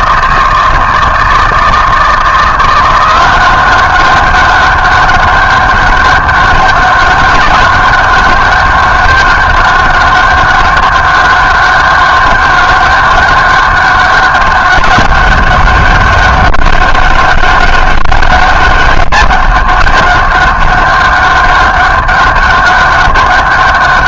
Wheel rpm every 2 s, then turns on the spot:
160, 170, 200, 200, 200, 200, 200, 200, 200, 200, 200, 200.
none